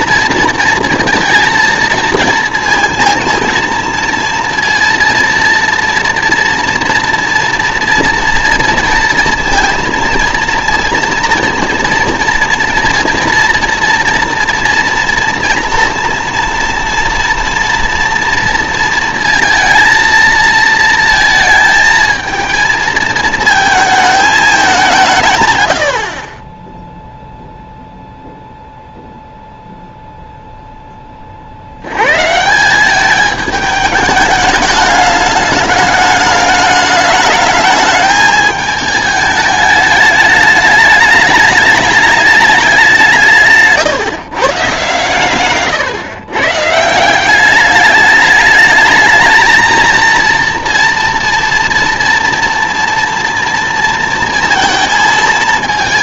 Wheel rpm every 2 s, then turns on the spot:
230, 230, 230, 230, 230, 230, 240, 240, 230, 230, 230, 230, 200, 10, 0, 0, 170, 210, 210, 220, 210, 210, 120, 150, 210, 240, 230, 230.
none